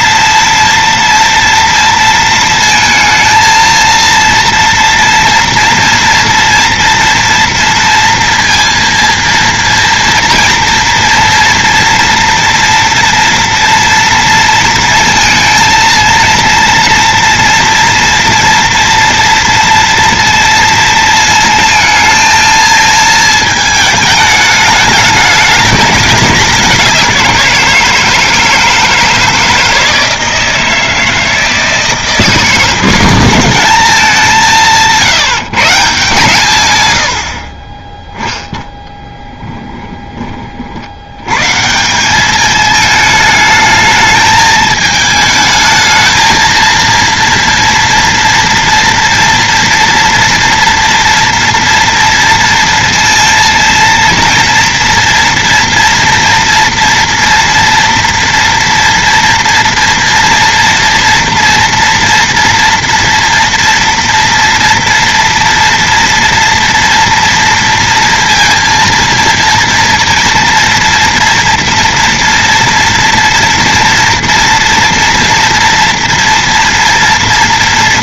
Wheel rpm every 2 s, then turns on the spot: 230, 230, 230, 230, 230, 230, 230, 230, 230, 230, 230, 220, 210, 190, 160, 160, 180, 170, 110, 0, 70, 220, 220, 230, 230, 230, 230, 230, 230, 230, 240, 230, 230, 230, 230, 230, 240, 230, 240.
none